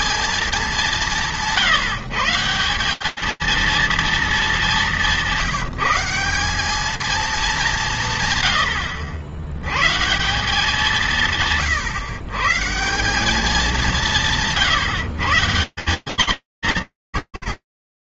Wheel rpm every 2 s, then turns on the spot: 170, 230, 150, 200, 100, 130, 200, 180, 180.
none